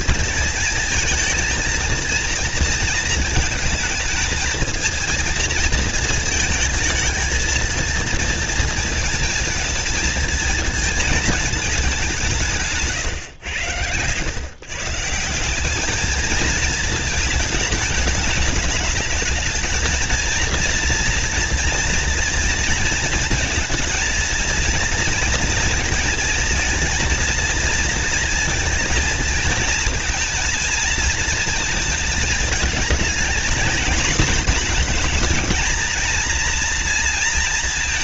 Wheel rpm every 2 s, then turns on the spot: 230, 220, 230, 220, 230, 230, 130, 170, 220, 220, 230, 230, 230, 220, 230, 230, 220, 220, 230.
none